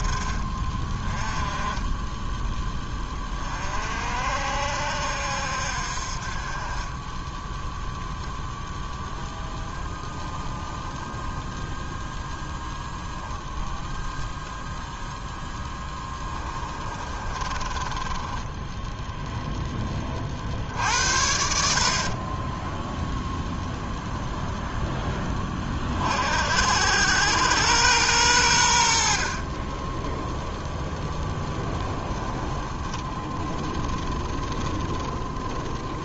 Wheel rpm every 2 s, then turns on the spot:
20, 20, 60, 20, 0, 10, 0, 0, 30, 0, 60, 0, 10, 80, 60, 0, 10, 20.
10-12 16-18 32-36